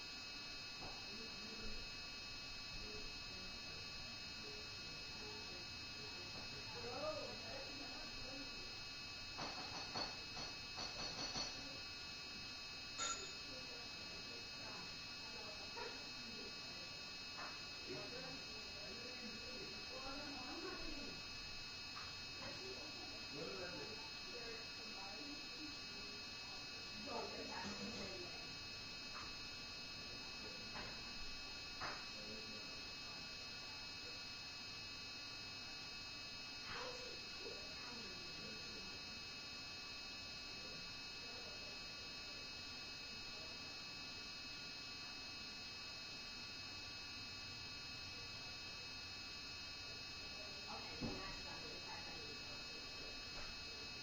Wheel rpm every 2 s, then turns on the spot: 0, 0, 0, 0, 0, 0, 0, 0, 0, 0, 0, 0, 0, 0, 0, 0, 0, 0, 0, 0, 0, 0, 0, 0, 0, 0, 0.
none